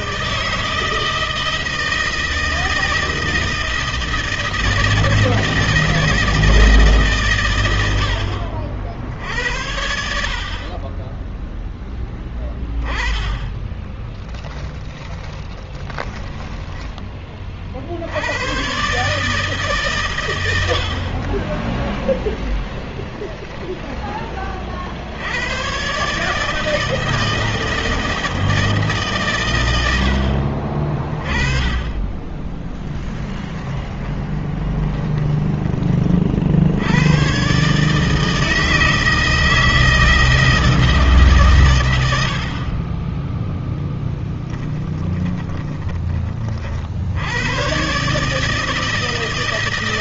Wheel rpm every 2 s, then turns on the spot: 160, 160, 160, 140, 70, 20, 10, 10, 20, 130, 60, 10, 50, 160, 150, 50, 10, 20, 90, 160, 160, 20, 20, 70, 160.
14-16 22-24 34-36 44-46